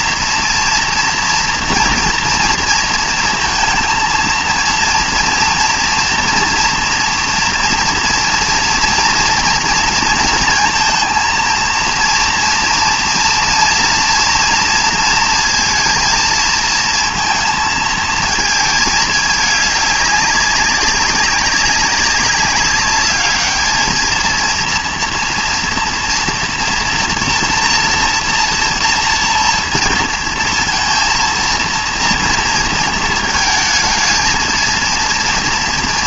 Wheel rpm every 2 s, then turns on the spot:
230, 230, 230, 230, 230, 230, 230, 230, 230, 220, 190, 200, 230, 240, 230, 230, 230, 230.
none